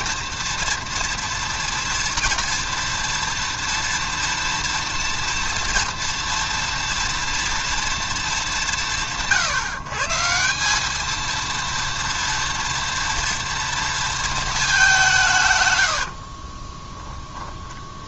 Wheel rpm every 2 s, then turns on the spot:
230, 240, 230, 230, 180, 200, 230, 210, 20.
16-18